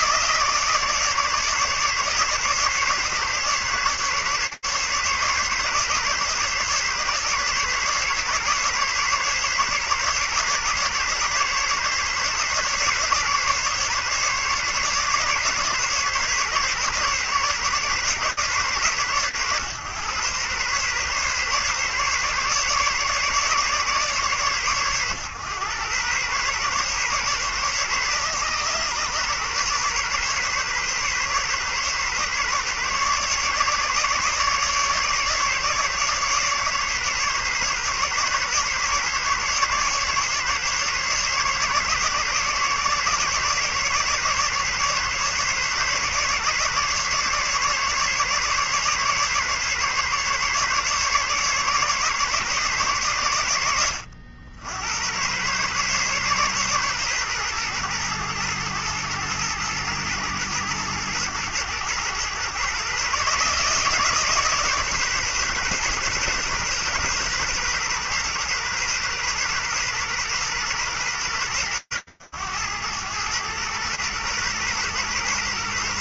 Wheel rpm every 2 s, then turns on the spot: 160, 150, 140, 140, 140, 140, 140, 140, 140, 130, 140, 140, 120, 140, 130, 130, 140, 150, 140, 140, 150, 140, 140, 140, 140, 140, 70, 130, 120, 110, 120, 150, 130, 130, 130, 100, 80, 120.
none